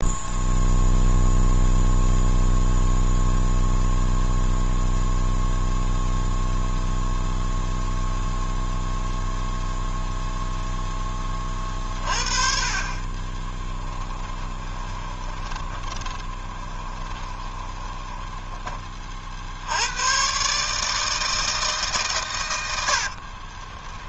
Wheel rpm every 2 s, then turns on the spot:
0, 0, 0, 0, 0, 0, 40, 20, 20, 20, 150, 80.
14-18 22-24